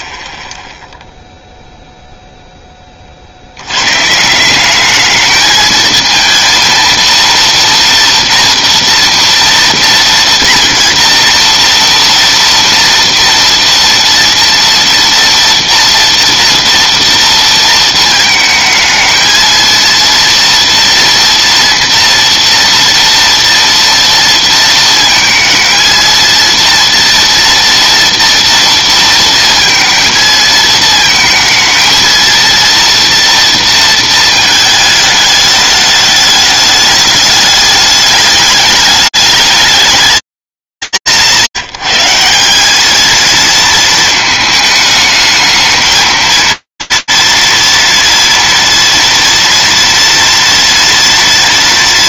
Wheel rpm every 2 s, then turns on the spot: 0, 20, 200, 230, 230, 230, 230, 230, 230, 220, 230, 230, 230, 230, 230, 220, 230, 220, 210, 210, 180, 180, 220, 230, 230, 230.
none